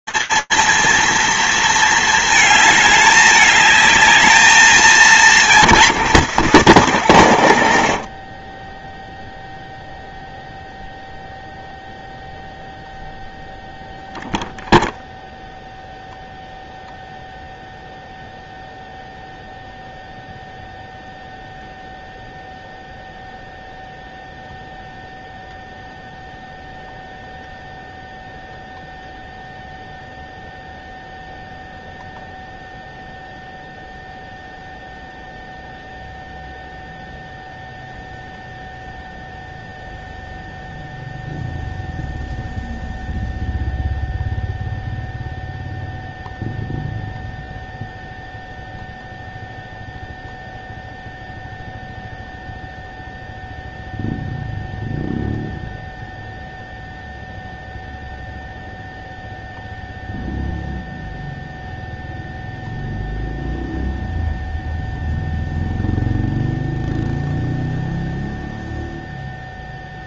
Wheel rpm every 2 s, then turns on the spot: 230, 210, 220, 150, 20, 0, 0, 0, 0, 0, 0, 0, 0, 0, 0, 0, 0, 0, 0, 0, 0, 0, 0, 0, 0, 0, 0, 0, 0, 0, 0, 0, 0, 0, 0.
6-10